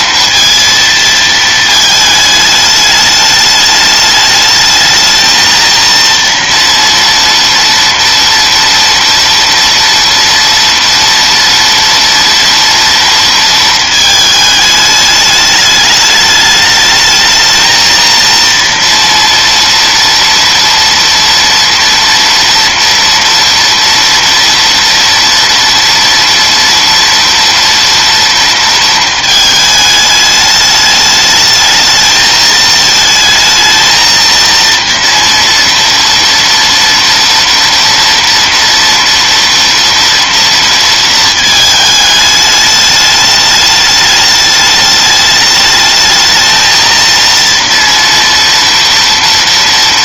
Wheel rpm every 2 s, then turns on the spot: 230, 210, 220, 230, 230, 230, 230, 210, 220, 230, 230, 230, 230, 230, 220, 210, 220, 230, 230, 230, 230, 210, 210, 230, 230.
none